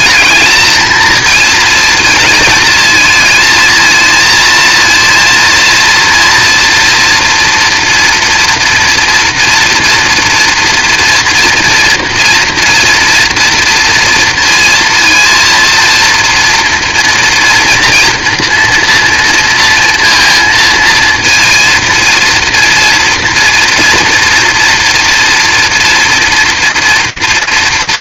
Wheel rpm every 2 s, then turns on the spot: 230, 220, 230, 230, 230, 230, 230, 230, 240, 240, 230, 230, 230, 230.
none